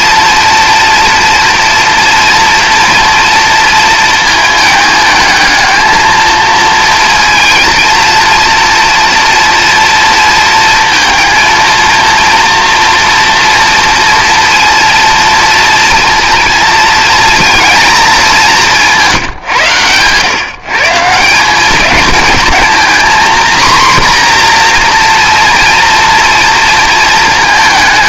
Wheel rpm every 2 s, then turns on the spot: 230, 230, 220, 230, 230, 230, 230, 230, 240, 180, 160, 230, 240, 230.
none